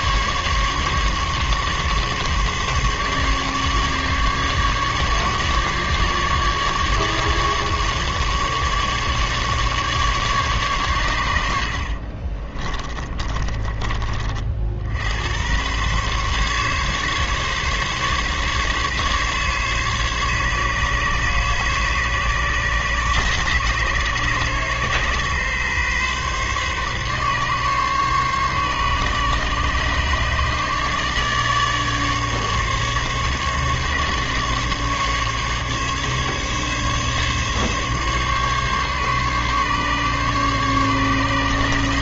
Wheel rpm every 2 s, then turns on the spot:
140, 140, 140, 150, 150, 130, 30, 60, 140, 140, 140, 140, 130, 140, 140, 150, 150, 140, 140, 140, 140.
12-14